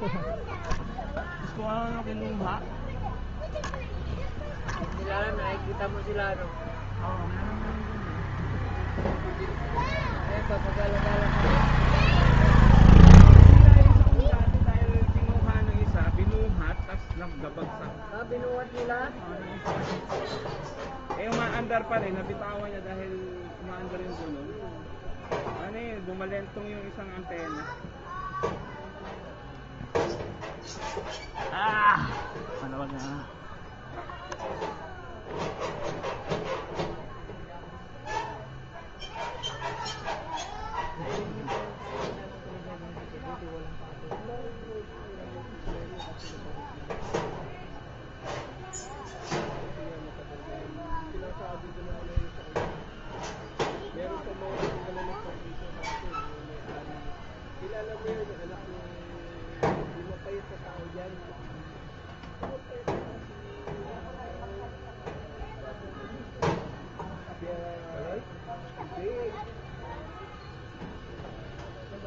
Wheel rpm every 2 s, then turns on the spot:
0, 0, 0, 0, 0, 0, 0, 0, 0, 0, 0, 0, 0, 0, 0, 0, 0, 0, 0, 0, 0, 0, 0, 0, 0, 0, 0, 0, 0, 0, 0, 0, 0, 0, 0, 0.
none